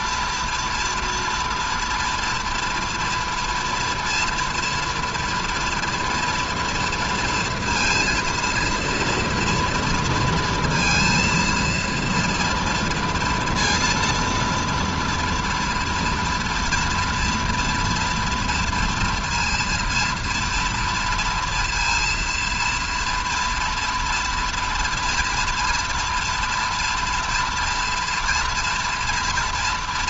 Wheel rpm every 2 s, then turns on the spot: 240, 230, 230, 230, 230, 230, 230, 230, 230, 230, 230, 230, 230, 230, 230.
none